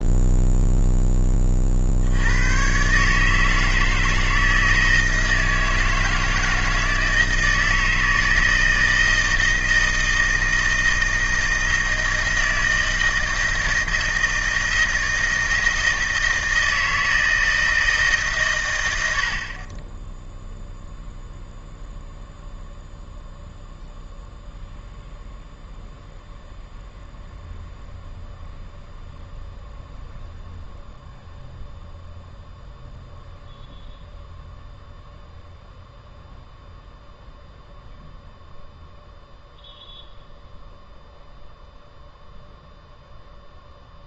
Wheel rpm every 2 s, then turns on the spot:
0, 110, 160, 160, 160, 160, 160, 160, 160, 120, 0, 0, 0, 0, 0, 0, 0, 0, 0, 0, 0, 0.
none